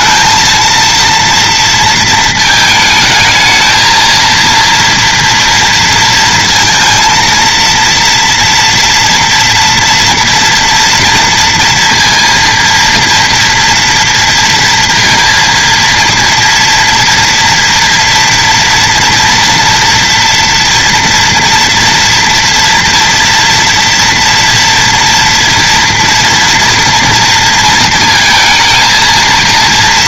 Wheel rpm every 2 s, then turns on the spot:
230, 220, 230, 230, 230, 240, 230, 230, 230, 230, 230, 230, 230, 230, 230.
none